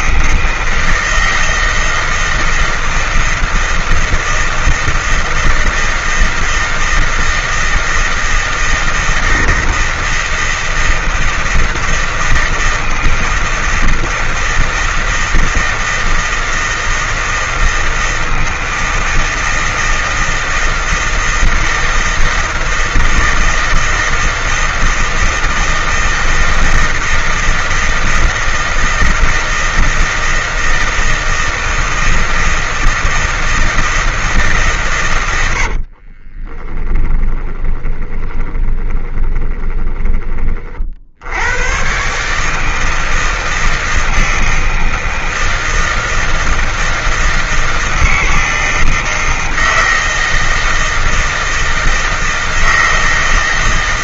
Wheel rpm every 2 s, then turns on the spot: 160, 160, 160, 160, 160, 160, 160, 160, 160, 160, 160, 160, 160, 160, 160, 160, 160, 150, 20, 20, 40, 160, 160, 160, 160, 160, 160.
36-40